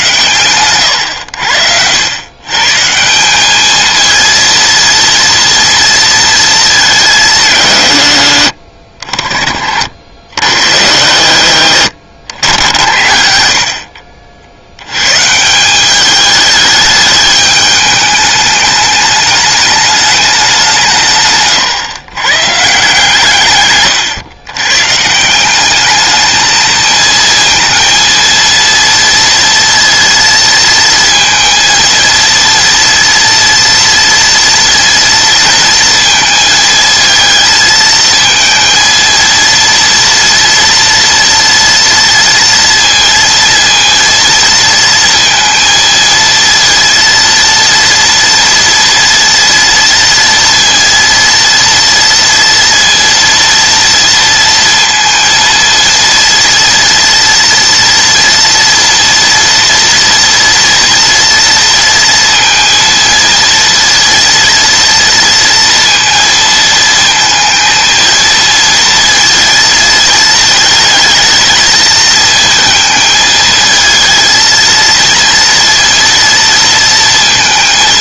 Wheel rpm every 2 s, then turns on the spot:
120, 150, 230, 200, 50, 80, 80, 90, 210, 210, 180, 140, 130, 220, 230, 230, 230, 230, 220, 230, 230, 230, 230, 230, 230, 230, 230, 230, 230, 230, 230, 230, 230, 230, 230, 220, 220, 230, 230.
none